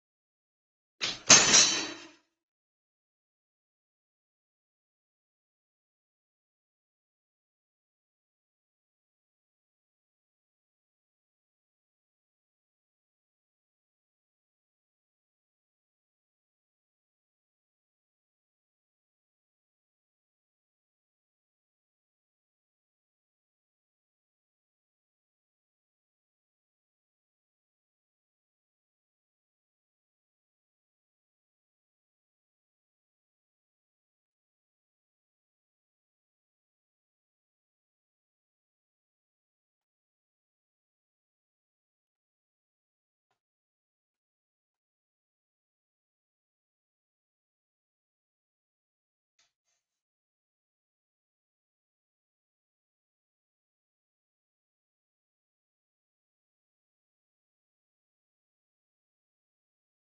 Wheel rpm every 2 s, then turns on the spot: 0, 0, 0, 0, 0, 0, 0, 0, 0, 0, 0, 0, 0, 0, 0, 0, 0, 0, 0, 0, 0, 0, 0, 0, 0, 0, 0, 0, 0, 0.
none